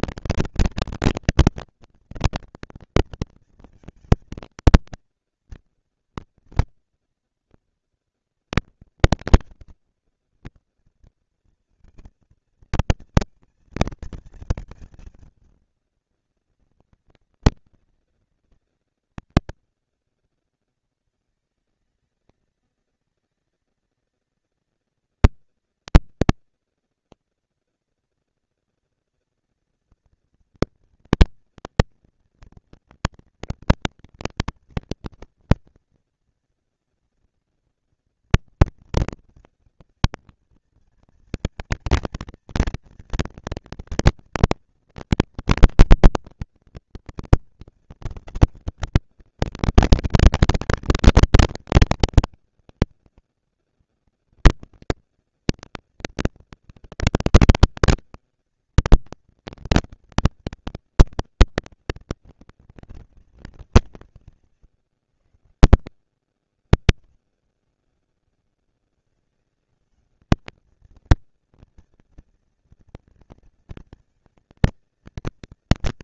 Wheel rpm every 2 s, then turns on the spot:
230, 230, 230, 230, 230, 230, 230, 230, 200, 190, 210, 220, 230, 230, 230, 230, 230, 240, 230, 230, 230, 220, 230, 240, 230, 220, 230, 230, 240, 230, 230, 200, 150, 110, 190, 210, 230, 230.
none